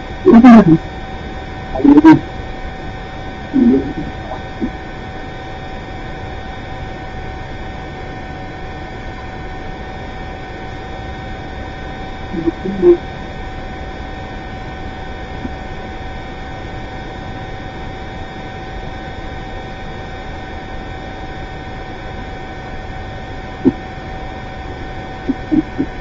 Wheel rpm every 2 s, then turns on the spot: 0, 0, 0, 0, 0, 0, 0, 0, 0, 0, 0, 0, 0.
none